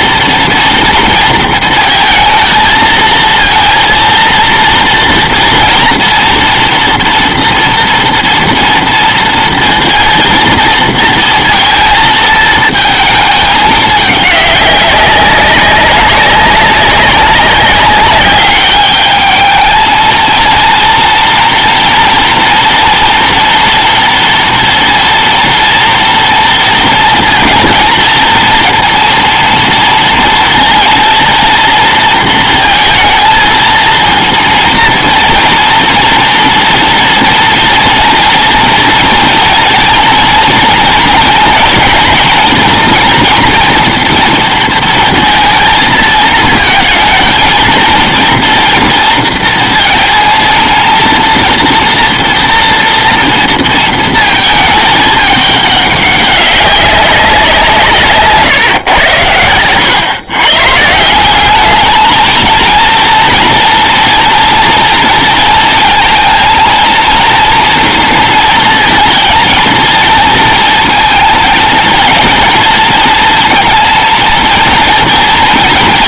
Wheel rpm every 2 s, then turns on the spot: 230, 230, 230, 230, 230, 230, 230, 200, 190, 200, 230, 230, 230, 230, 230, 230, 230, 230, 240, 230, 230, 230, 230, 220, 230, 230, 230, 220, 200, 140, 130, 230, 230, 230, 230, 230, 230, 230.
none